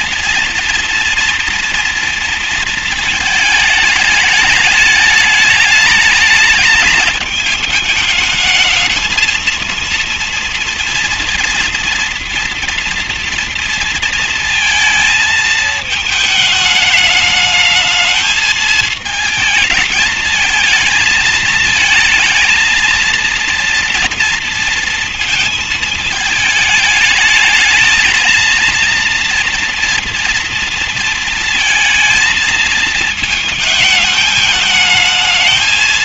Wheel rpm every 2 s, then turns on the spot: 230, 230, 210, 210, 210, 230, 230, 230, 220, 220, 220, 230, 230, 210, 230, 230, 230, 210.
none